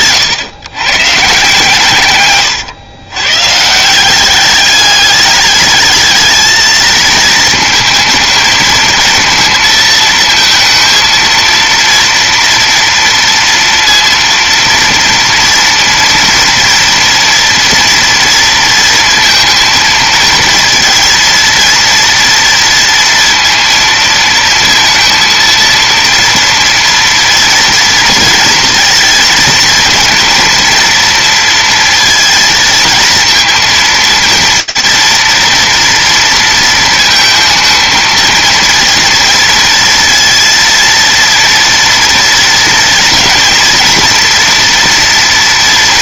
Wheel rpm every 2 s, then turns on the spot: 120, 130, 200, 220, 220, 230, 230, 230, 230, 230, 230, 230, 230, 230, 230, 230, 230, 230, 230, 230, 230, 230, 230.
none